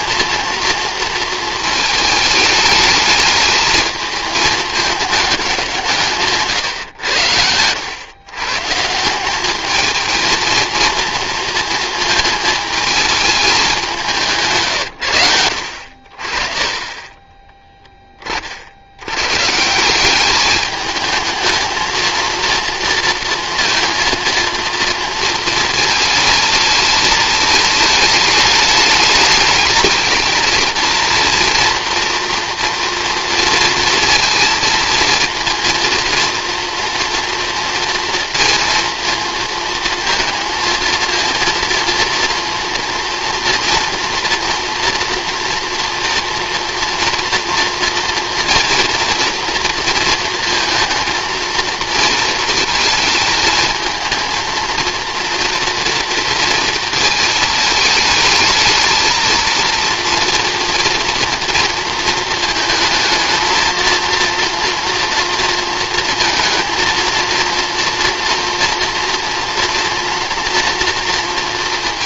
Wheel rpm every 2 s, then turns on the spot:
230, 210, 210, 110, 160, 230, 220, 120, 20, 80, 210, 230, 230, 220, 210, 230, 230, 230, 230, 230, 230, 230, 230, 240, 230, 230, 230, 230, 220, 220, 230, 220, 230, 230, 230, 230.
none